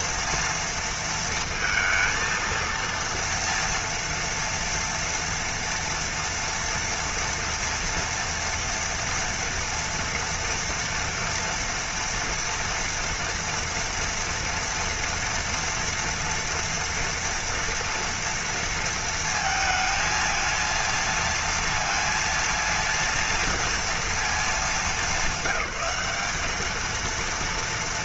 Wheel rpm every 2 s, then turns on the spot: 230, 230, 230, 240, 230, 230, 230, 230, 230, 230, 230, 230, 210, 210.
none